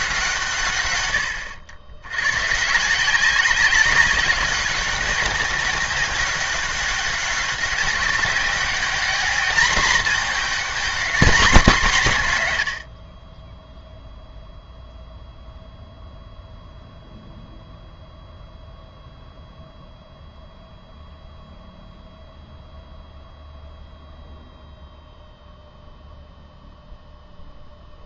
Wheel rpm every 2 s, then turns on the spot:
140, 150, 190, 190, 190, 230, 120, 0, 0, 0, 0, 0, 0, 0.
none